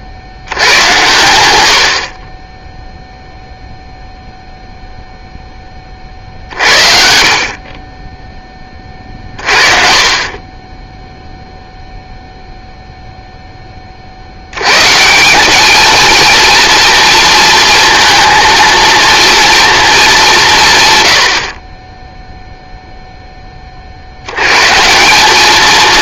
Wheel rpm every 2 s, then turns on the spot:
50, 0, 0, 50, 30, 10, 0, 110, 230, 230, 120, 0, 150.
6-8